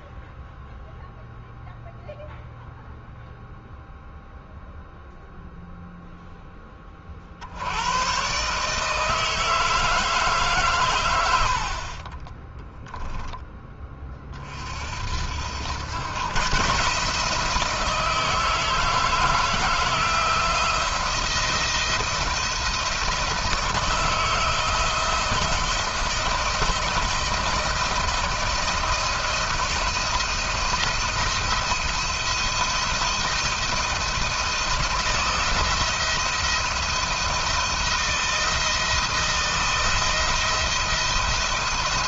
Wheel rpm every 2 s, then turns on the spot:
0, 0, 0, 20, 150, 130, 10, 50, 140, 160, 170, 170, 160, 170, 170, 170, 170, 160, 170, 170, 170.
none